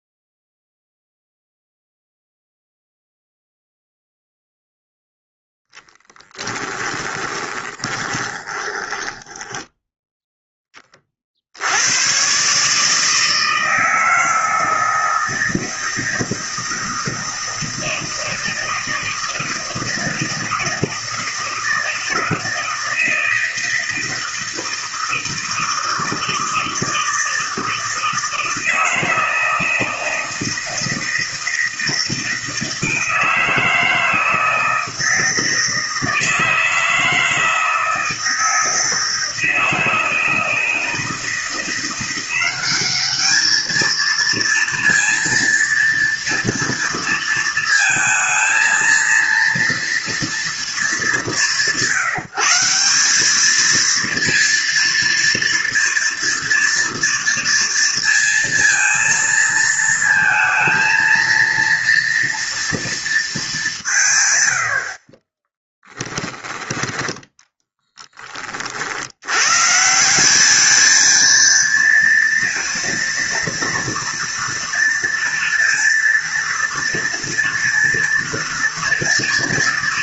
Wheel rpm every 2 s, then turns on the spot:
0, 0, 0, 20, 20, 20, 150, 160, 160, 160, 160, 160, 160, 160, 160, 160, 160, 160, 160, 160, 160, 190, 230, 230, 230, 200, 170, 230, 230, 230, 230, 230, 70, 10, 50, 210, 230, 230, 230, 230.
6-10